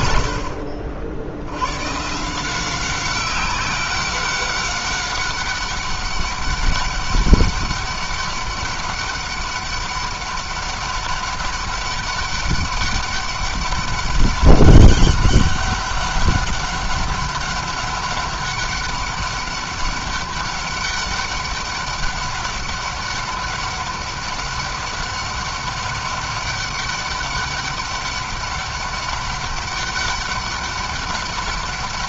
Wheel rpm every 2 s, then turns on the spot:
60, 180, 190, 200, 200, 200, 200, 200, 200, 200, 200, 200, 200, 200, 200, 200.
none